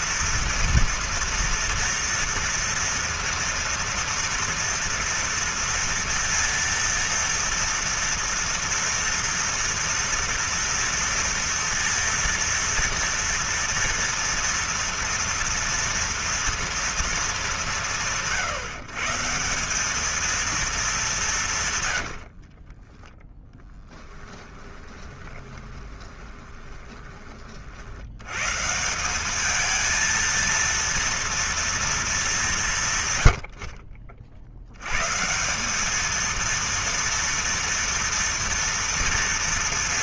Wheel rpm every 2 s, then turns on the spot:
230, 230, 230, 230, 230, 230, 230, 230, 230, 140, 220, 50, 20, 20, 140, 230, 170, 90, 230, 230.
22-28